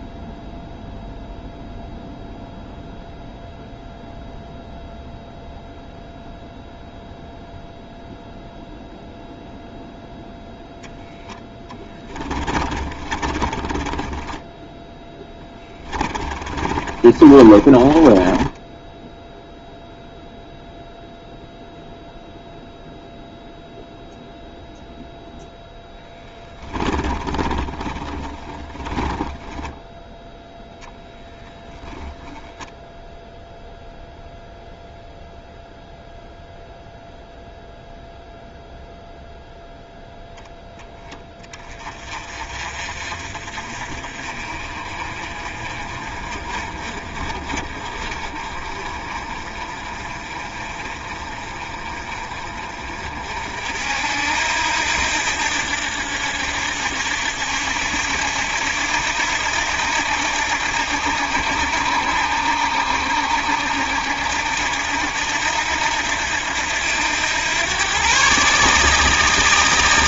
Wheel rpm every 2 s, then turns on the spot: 0, 0, 0, 0, 0, 0, 30, 10, 30, 10, 0, 0, 0, 10, 20, 0, 0, 0, 0, 0, 10, 40, 40, 40, 40, 40, 40, 70, 70, 70, 80, 70, 70, 80, 150.
12-20 26-30